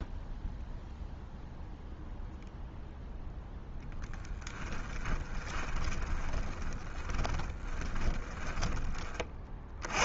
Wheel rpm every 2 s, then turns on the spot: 0, 0, 10, 20, 30.
4-8